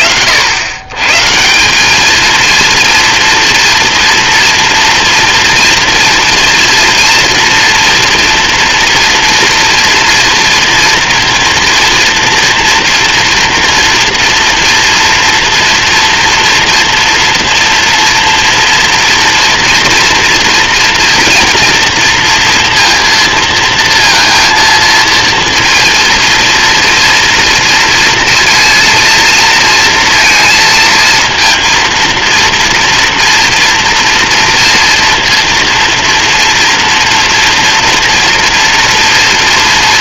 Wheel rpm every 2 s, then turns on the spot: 100, 230, 240, 240, 230, 230, 230, 230, 230, 240, 230, 230, 230, 230, 230, 230, 230, 230, 230, 230.
none